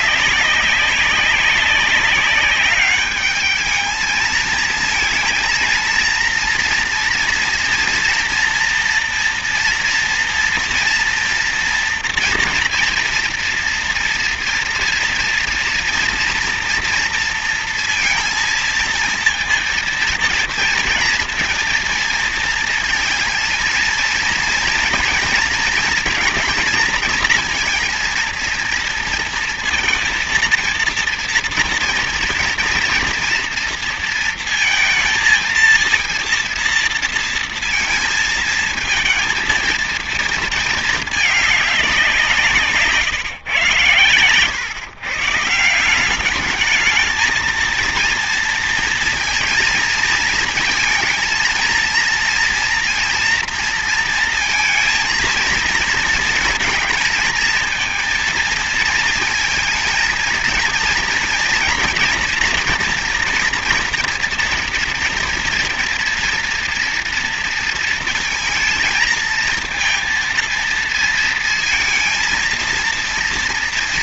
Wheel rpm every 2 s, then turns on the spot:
190, 200, 220, 230, 230, 230, 230, 230, 230, 230, 230, 230, 230, 240, 230, 230, 230, 230, 230, 220, 220, 170, 110, 210, 230, 230, 230, 230, 230, 230, 230, 240, 240, 230, 230, 230, 230.
none